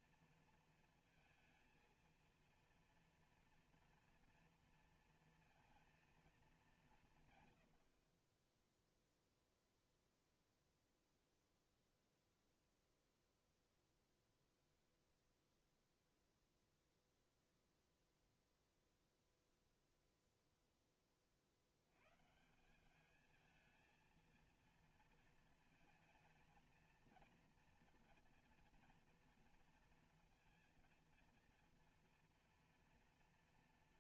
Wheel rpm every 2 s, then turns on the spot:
230, 230, 230, 200, 0, 0, 0, 0, 0, 0, 0, 170, 230, 230, 230, 230, 230.
none